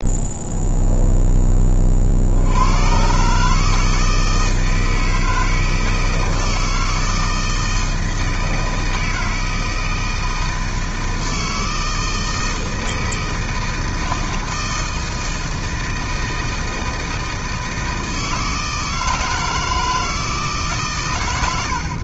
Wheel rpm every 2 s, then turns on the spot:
0, 100, 160, 160, 160, 160, 160, 160, 160, 160, 140.
none